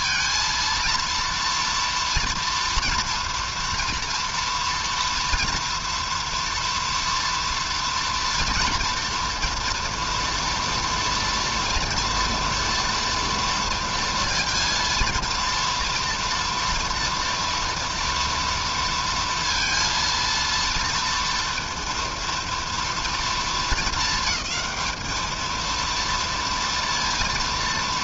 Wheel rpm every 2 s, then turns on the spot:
230, 230, 230, 230, 230, 230, 230, 230, 230, 230, 230, 230, 220, 230.
none